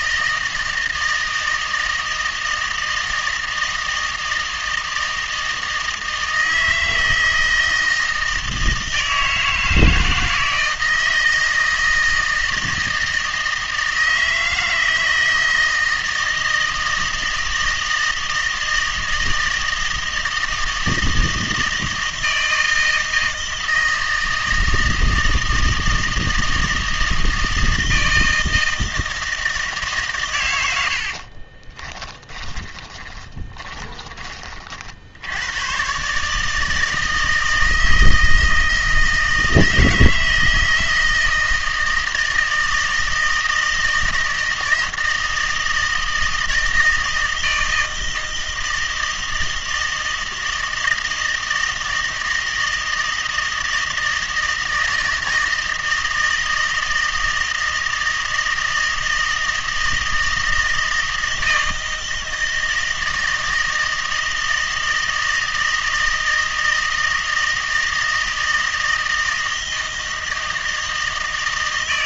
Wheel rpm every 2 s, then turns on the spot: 160, 160, 160, 160, 160, 160, 160, 160, 160, 160, 160, 160, 160, 160, 160, 90, 20, 40, 160, 160, 160, 160, 160, 160, 160, 160, 160, 160, 160, 160, 160, 160, 160, 160, 160, 160.
32-34